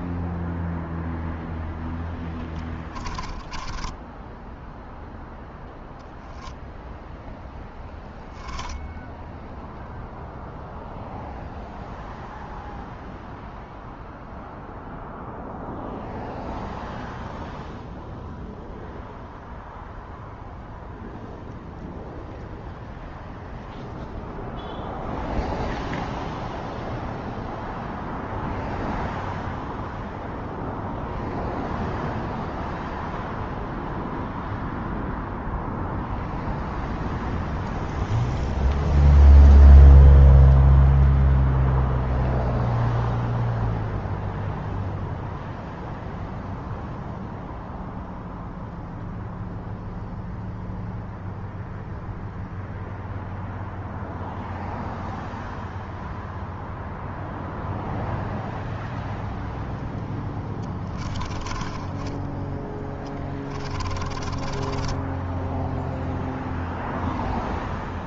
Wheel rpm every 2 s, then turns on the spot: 0, 20, 0, 10, 0, 0, 0, 0, 0, 0, 0, 0, 0, 0, 0, 0, 0, 0, 0, 0, 0, 0, 0, 0, 0, 0, 0, 0, 0, 0, 20, 20, 10, 0.
2-4 60-66